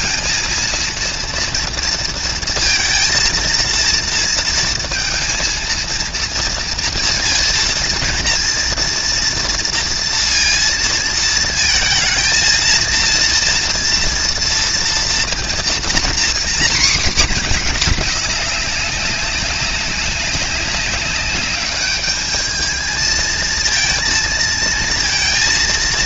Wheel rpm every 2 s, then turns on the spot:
230, 230, 230, 230, 230, 230, 230, 230, 250, 190, 200, 220, 230.
none